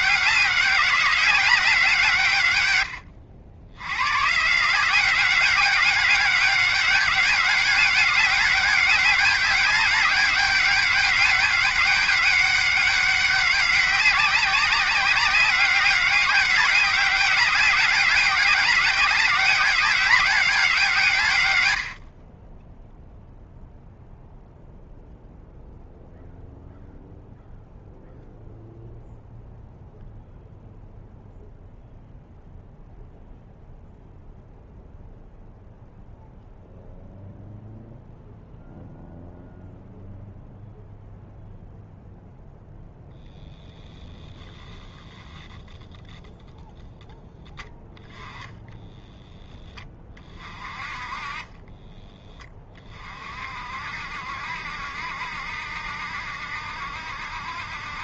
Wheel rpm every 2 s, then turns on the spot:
190, 100, 180, 200, 200, 200, 200, 190, 200, 200, 160, 0, 0, 0, 0, 0, 0, 0, 0, 0, 0, 0, 0, 10, 10, 30, 40, 70, 60.
48-50